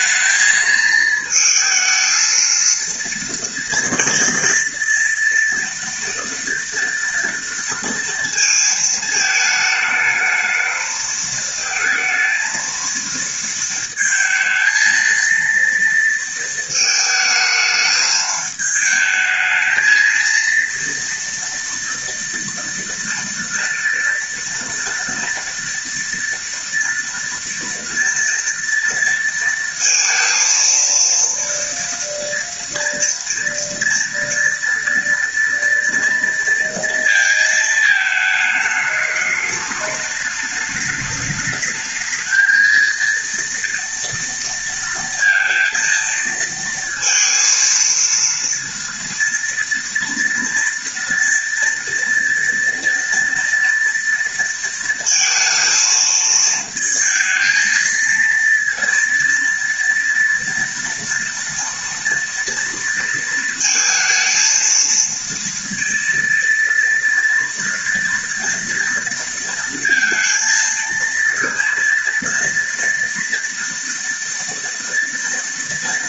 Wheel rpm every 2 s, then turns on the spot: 220, 230, 230, 230, 230, 220, 230, 230, 220, 210, 230, 230, 230, 230, 230, 230, 230, 230, 230, 210, 210, 220, 230, 230, 230, 230, 240, 230, 220, 230, 230, 230, 230, 230, 230, 230, 230, 230.
none